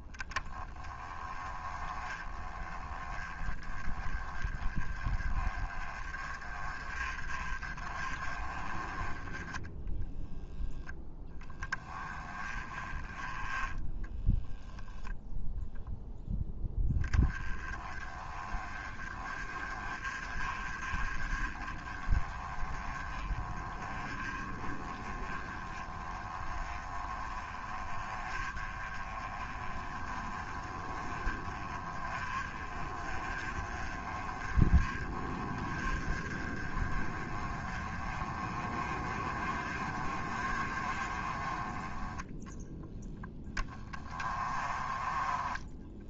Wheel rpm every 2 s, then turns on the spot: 10, 20, 20, 30, 20, 0, 10, 0, 10, 20, 30, 20, 20, 20, 20, 20, 30, 30, 30, 30, 30, 20, 20.
none